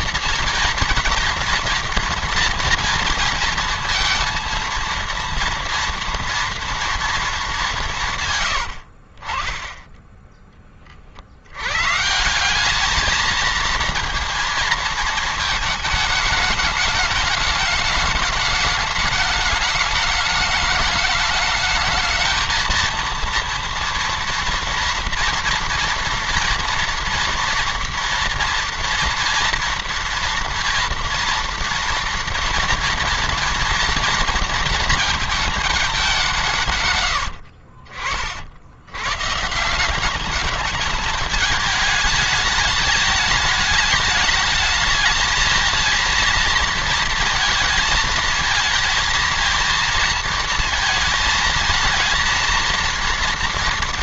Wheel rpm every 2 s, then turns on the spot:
240, 230, 230, 230, 90, 30, 190, 230, 210, 210, 210, 230, 230, 240, 230, 230, 230, 230, 140, 90, 220, 210, 210, 220, 220, 220, 230.
none